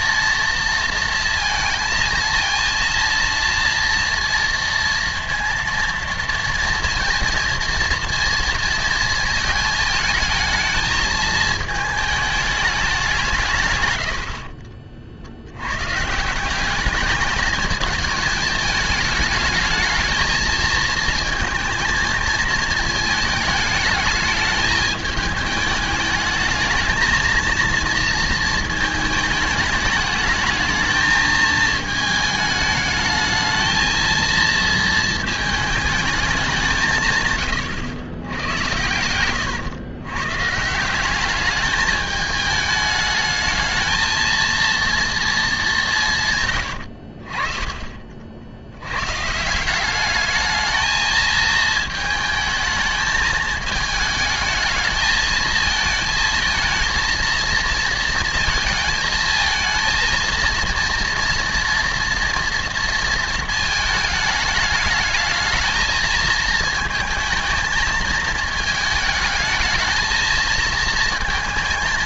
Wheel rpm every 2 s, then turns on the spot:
230, 230, 230, 230, 230, 220, 200, 50, 200, 210, 230, 220, 210, 220, 220, 210, 210, 230, 170, 100, 170, 210, 230, 100, 90, 220, 220, 220, 230, 220, 230, 230, 210, 220, 220, 230.
none